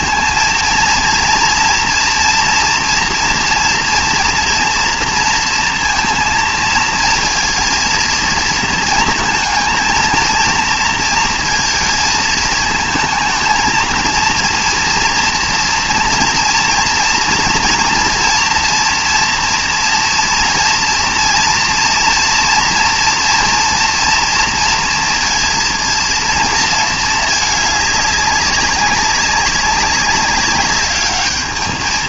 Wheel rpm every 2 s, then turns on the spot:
230, 230, 230, 230, 230, 230, 220, 230, 230, 230, 230, 240, 240, 230, 200, 200.
none